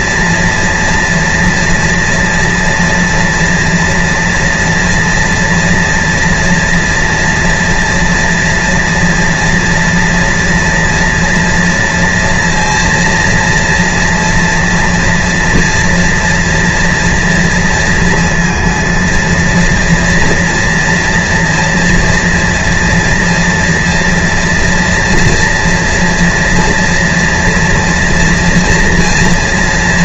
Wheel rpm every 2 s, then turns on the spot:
230, 240, 230, 240, 230, 230, 240, 240, 230, 230, 230, 230, 230, 230, 230.
none